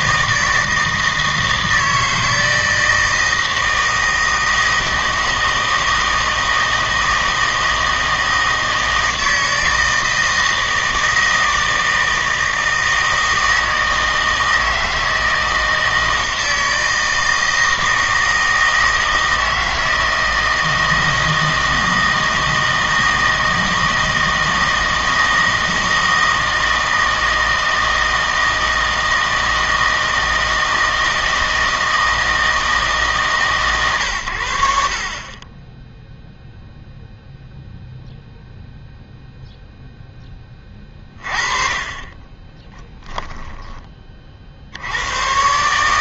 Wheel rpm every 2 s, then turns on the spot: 160, 160, 160, 160, 160, 160, 160, 160, 160, 160, 160, 160, 160, 160, 160, 160, 160, 70, 0, 0, 20, 20, 60.
42-44